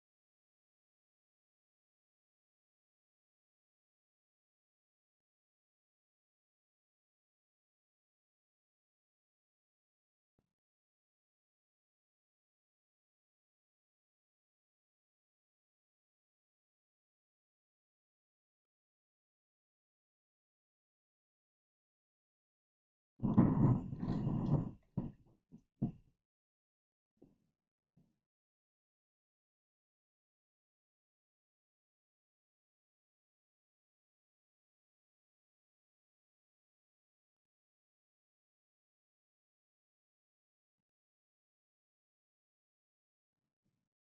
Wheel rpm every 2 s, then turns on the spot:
0, 0, 0, 0, 0, 0, 0, 0, 0, 0, 0, 0, 0, 0, 0, 0, 0, 0, 0, 0, 0, 0.
none